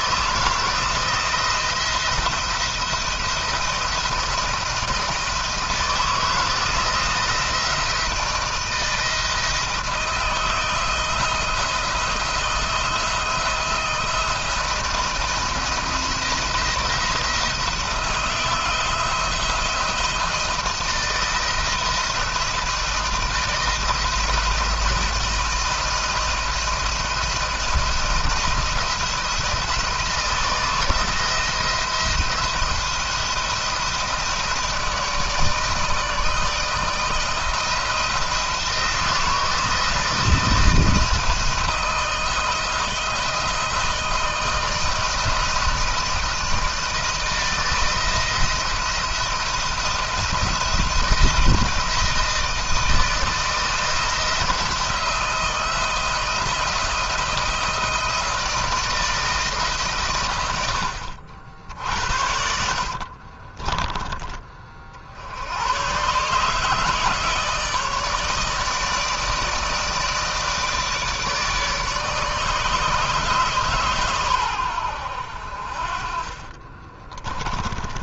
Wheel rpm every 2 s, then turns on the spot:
160, 170, 170, 160, 160, 170, 170, 160, 170, 170, 170, 160, 160, 170, 170, 170, 170, 160, 160, 170, 160, 160, 160, 160, 160, 170, 160, 170, 160, 160, 100, 70, 30, 150, 150, 160, 150, 110, 30.
62-64 76-78